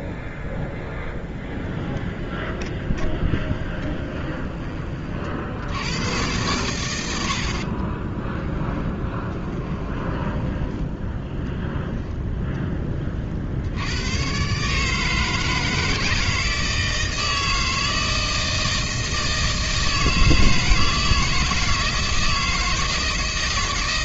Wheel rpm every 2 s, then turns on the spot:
0, 20, 30, 90, 20, 10, 20, 150, 160, 160, 160, 160.
2-4 8-10